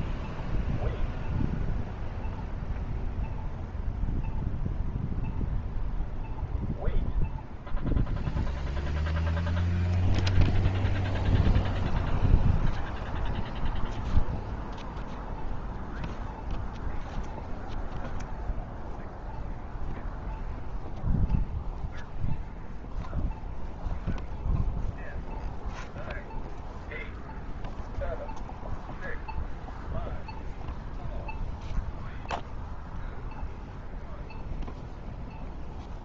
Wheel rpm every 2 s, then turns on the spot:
0, 0, 0, 0, 0, 0, 0, 0, 0, 0, 0, 0, 0, 0, 0, 0, 0, 0.
none